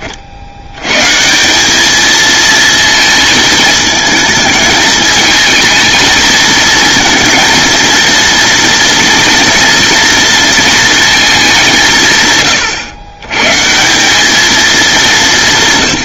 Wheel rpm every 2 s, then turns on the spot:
130, 220, 210, 230, 240, 230, 110, 190.
none